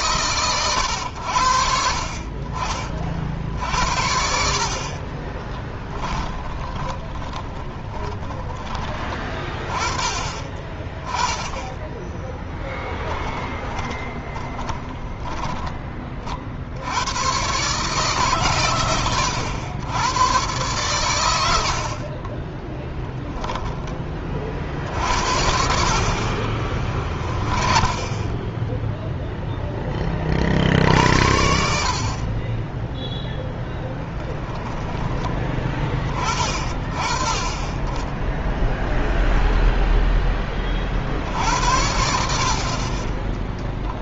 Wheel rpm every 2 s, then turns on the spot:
120, 50, 50, 20, 20, 20, 10, 10, 60, 130, 120, 20, 40, 30, 10, 50, 20, 10, 20, 10, 20, 40.
4-8 12-16 22-24 26-28 38-40